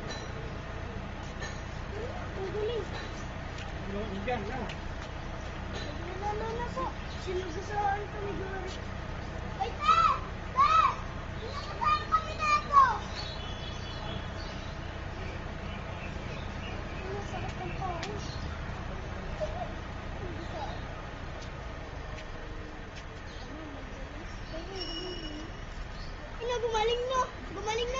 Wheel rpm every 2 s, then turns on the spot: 0, 0, 0, 0, 0, 0, 0, 0, 0, 0, 0, 0, 0, 0.
none